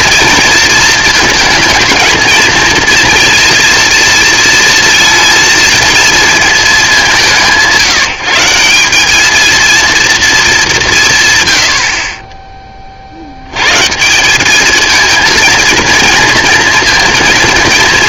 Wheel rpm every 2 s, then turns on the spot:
230, 230, 230, 220, 170, 210, 20, 210, 230.
none